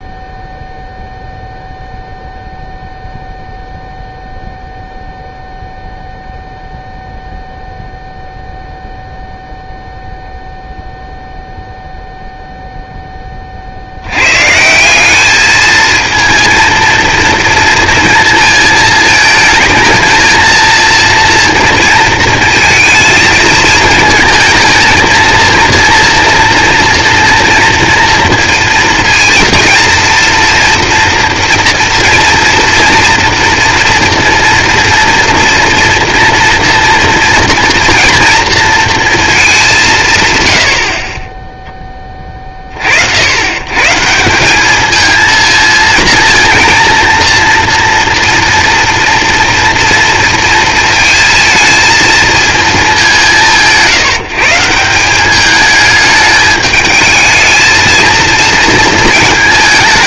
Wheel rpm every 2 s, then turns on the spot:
0, 0, 0, 0, 0, 0, 0, 150, 230, 230, 230, 220, 220, 230, 230, 230, 230, 230, 230, 230, 100, 40, 200, 230, 230, 230, 220, 170, 210, 230.
none